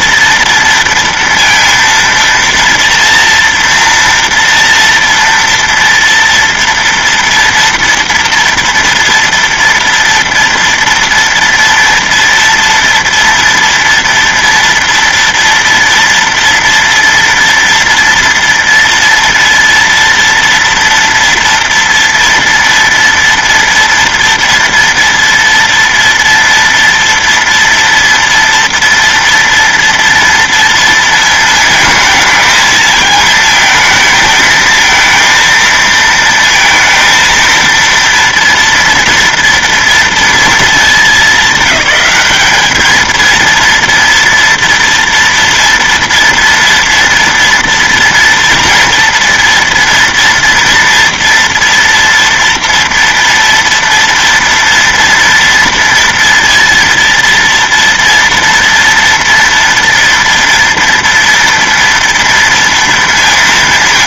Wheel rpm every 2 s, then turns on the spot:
230, 230, 230, 240, 230, 230, 230, 230, 230, 230, 230, 230, 230, 230, 230, 230, 220, 220, 230, 230, 230, 210, 230, 230, 230, 240, 230, 230, 230, 230, 230, 230.
none